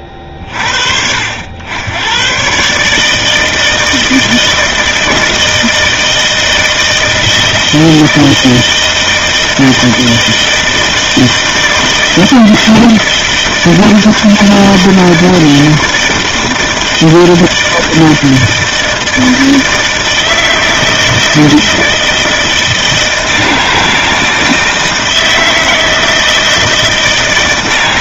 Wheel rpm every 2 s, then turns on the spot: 60, 150, 160, 160, 160, 160, 160, 160, 160, 160, 160, 160, 160, 160.
none